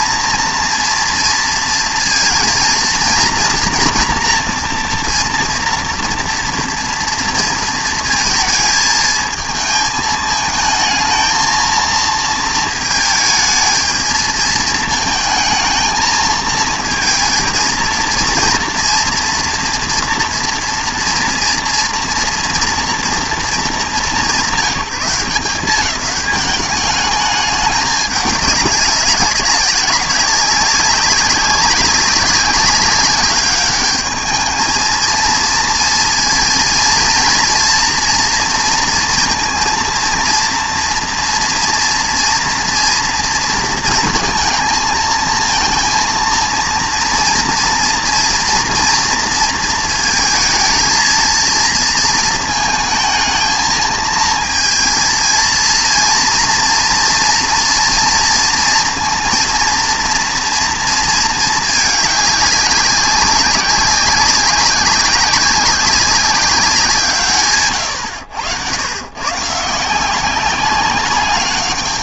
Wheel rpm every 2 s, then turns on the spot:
230, 230, 240, 240, 220, 220, 220, 220, 230, 230, 240, 230, 200, 200, 200, 190, 190, 220, 230, 230, 230, 230, 220, 230, 240, 230, 220, 230, 230, 230, 230, 200, 180, 190, 100, 190.
none